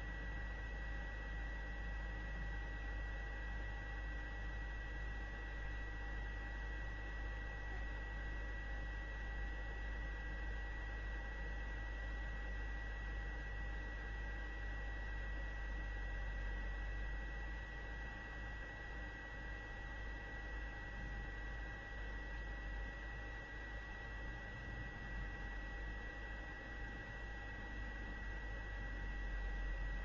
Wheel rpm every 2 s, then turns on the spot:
0, 0, 0, 0, 0, 0, 0, 0, 0, 0, 0, 0, 0, 0, 0.
none